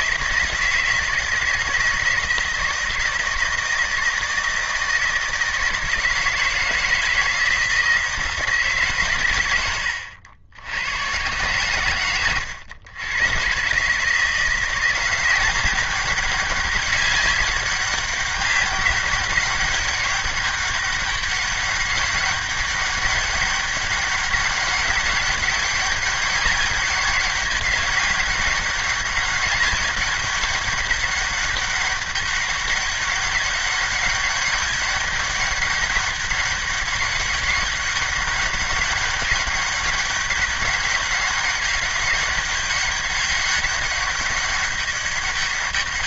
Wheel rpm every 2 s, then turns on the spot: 160, 160, 160, 160, 150, 90, 110, 170, 200, 200, 200, 200, 200, 200, 190, 200, 200, 200, 200, 200, 200, 190, 200.
none